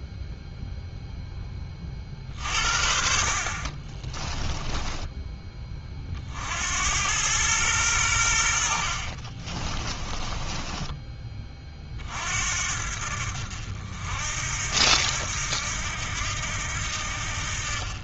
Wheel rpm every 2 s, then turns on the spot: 0, 50, 10, 80, 60, 20, 60, 70, 70.
4-6 10-12